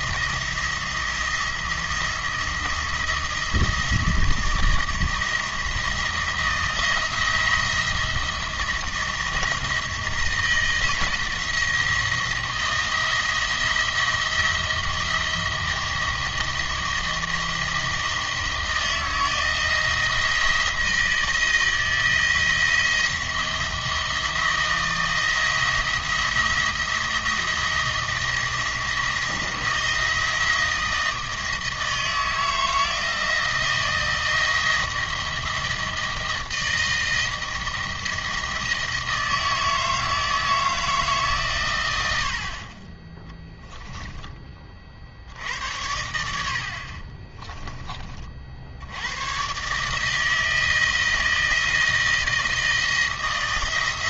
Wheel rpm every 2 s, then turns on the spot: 170, 170, 170, 170, 170, 160, 170, 170, 170, 160, 170, 170, 170, 170, 170, 160, 160, 160, 160, 160, 160, 40, 40, 70, 70, 160, 160.
none